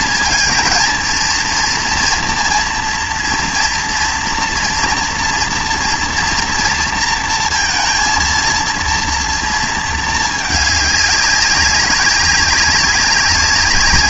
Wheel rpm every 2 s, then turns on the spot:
230, 230, 230, 230, 230, 210, 190.
none